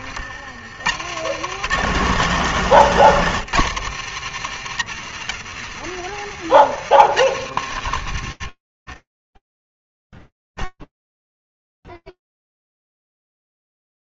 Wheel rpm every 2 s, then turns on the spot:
60, 160, 120, 110, 90, 30, 0.
8-10